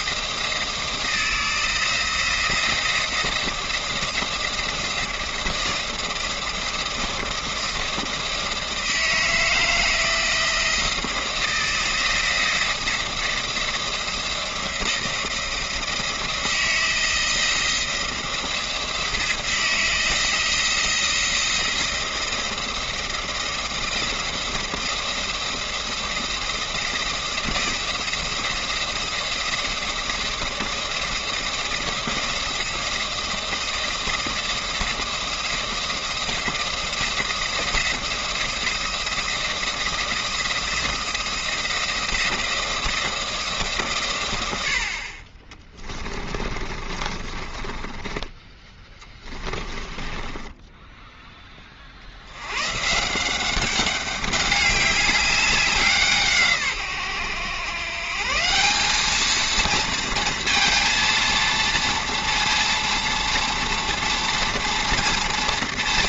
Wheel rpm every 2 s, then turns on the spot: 170, 170, 170, 170, 160, 170, 170, 170, 170, 160, 170, 170, 170, 170, 170, 170, 170, 170, 170, 170, 170, 170, 70, 30, 10, 10, 110, 200, 140, 190, 230, 230, 230.
46-52